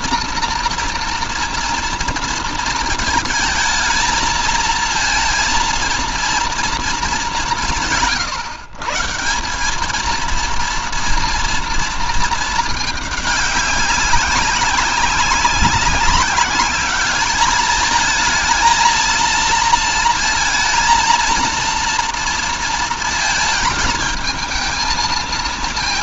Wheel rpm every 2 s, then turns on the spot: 230, 230, 230, 230, 140, 230, 220, 190, 200, 220, 230, 230, 220.
none